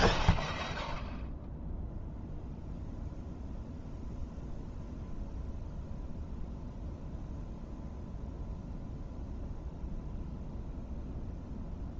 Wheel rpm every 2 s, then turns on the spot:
0, 0, 0, 0, 0, 0.
none